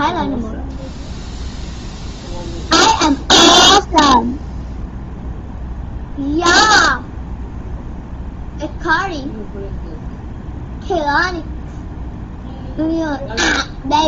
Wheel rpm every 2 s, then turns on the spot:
0, 0, 0, 0, 0, 0, 0.
none